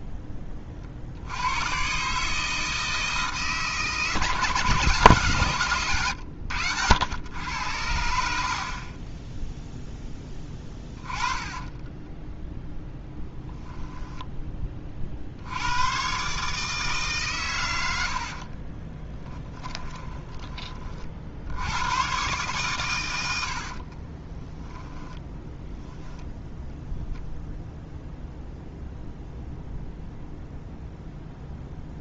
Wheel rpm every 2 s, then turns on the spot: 40, 160, 150, 90, 50, 20, 10, 20, 150, 30, 30, 120, 10, 0, 0, 0.
10-12 18-20 24-26